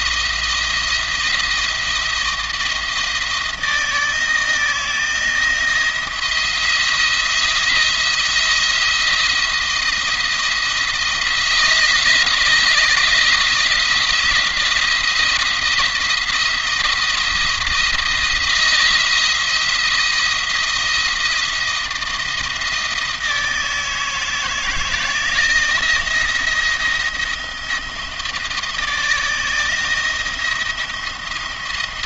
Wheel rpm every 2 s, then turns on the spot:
170, 170, 160, 170, 170, 170, 160, 170, 170, 170, 170, 160, 160, 170, 160, 170.
none